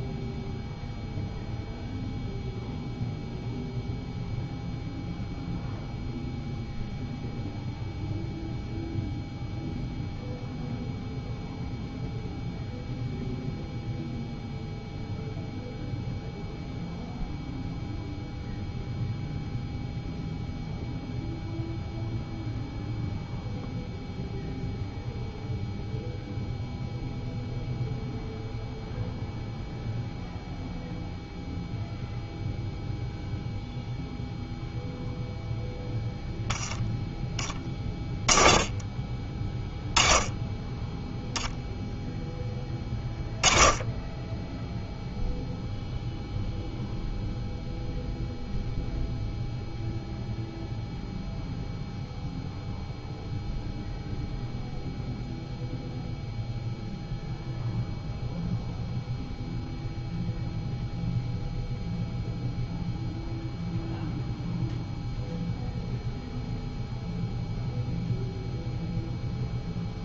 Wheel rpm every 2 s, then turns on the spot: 0, 0, 0, 0, 0, 0, 0, 0, 0, 0, 0, 0, 0, 0, 0, 0, 0, 0, 0, 10, 10, 10, 0, 0, 0, 0, 0, 0, 0, 0, 0, 0, 0, 0, 0.
none